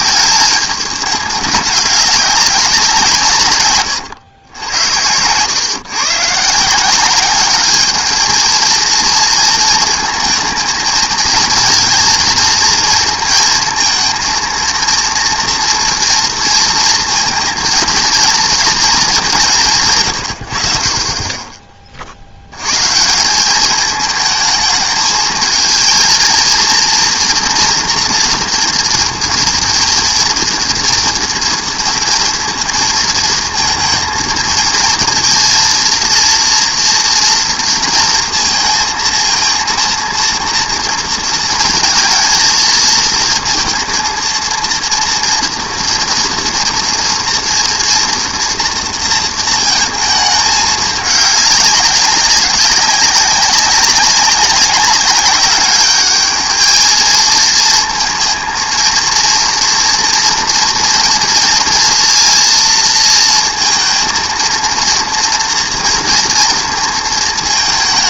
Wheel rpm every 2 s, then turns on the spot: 220, 190, 100, 170, 220, 220, 230, 230, 230, 220, 80, 110, 220, 230, 230, 230, 230, 230, 230, 230, 230, 220, 230, 230, 230, 210, 190, 200, 220, 230, 240, 230, 230, 230.
none